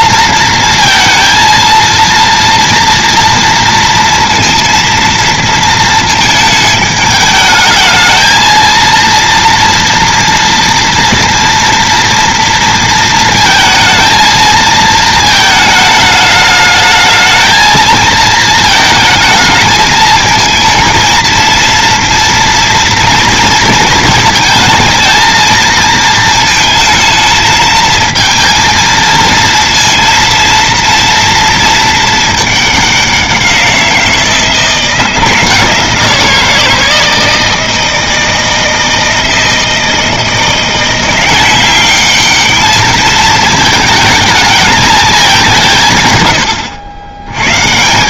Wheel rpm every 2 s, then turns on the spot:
230, 230, 230, 210, 230, 230, 230, 220, 210, 220, 220, 230, 220, 220, 230, 230, 210, 170, 160, 160, 170, 210, 220, 100.
none